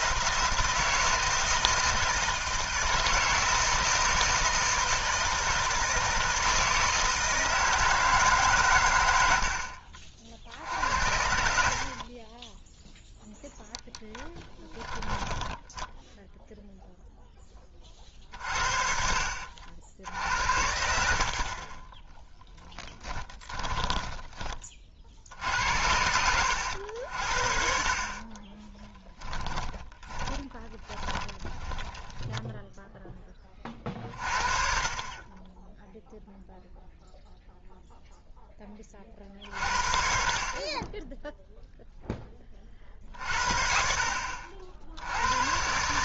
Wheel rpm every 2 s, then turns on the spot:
160, 160, 170, 160, 140, 60, 10, 20, 0, 50, 70, 10, 20, 80, 20, 20, 10, 40, 0, 20, 30, 30, 70.
14-16 22-24 28-32